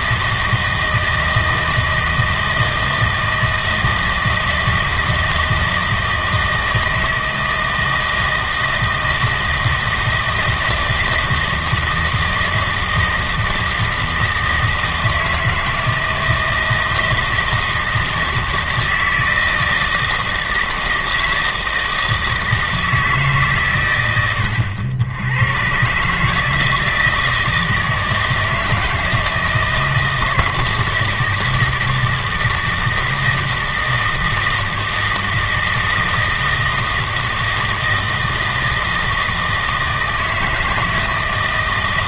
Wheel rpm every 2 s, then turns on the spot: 160, 160, 160, 160, 160, 160, 160, 160, 160, 160, 160, 160, 80, 160, 160, 160, 160, 160, 160, 160, 160.
none